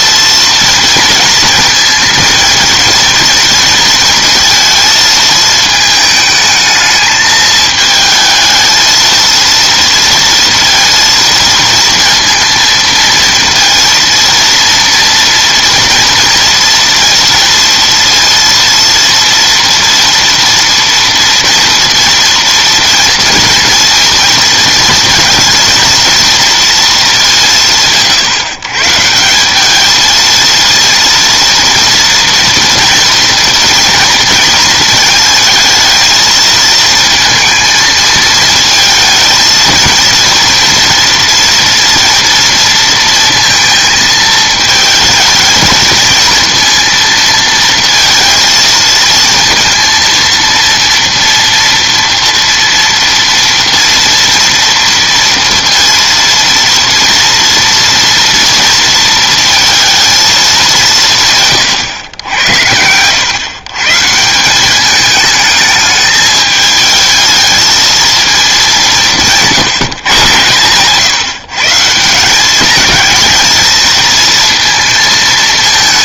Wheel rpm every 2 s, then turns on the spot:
230, 230, 220, 220, 220, 230, 230, 230, 230, 230, 240, 230, 220, 230, 120, 230, 230, 230, 220, 220, 230, 230, 220, 230, 230, 230, 230, 230, 230, 230, 210, 90, 180, 210, 200, 120, 200, 220.
none